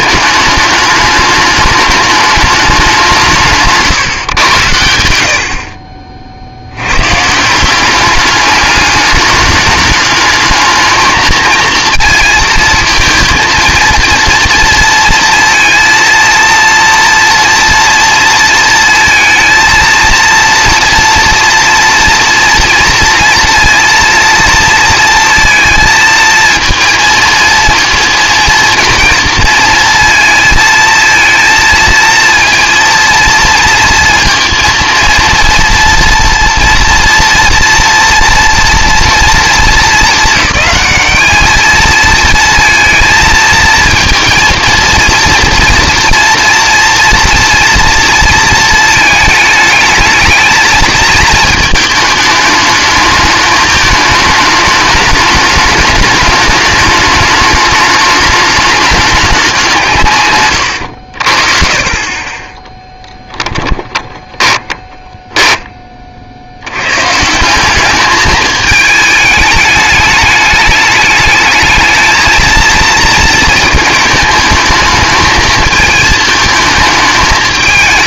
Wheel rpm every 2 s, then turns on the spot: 210, 200, 100, 70, 200, 220, 230, 230, 230, 220, 230, 240, 230, 230, 230, 230, 230, 230, 230, 230, 210, 230, 230, 230, 230, 220, 210, 220, 210, 210, 120, 20, 10, 90, 210, 210, 220, 220, 220.
64-66